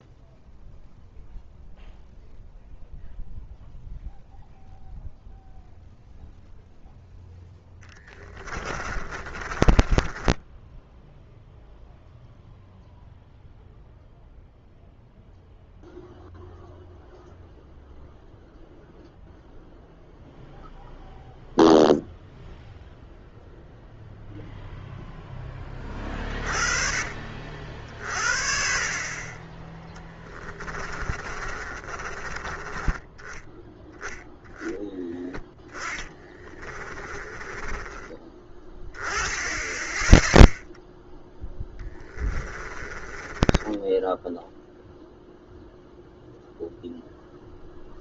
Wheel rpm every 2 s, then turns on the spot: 0, 0, 0, 0, 30, 10, 0, 0, 0, 0, 0, 0, 0, 40, 30, 20, 20, 10, 30, 10, 0, 20, 0, 0.
8-12 30-32 36-38 42-44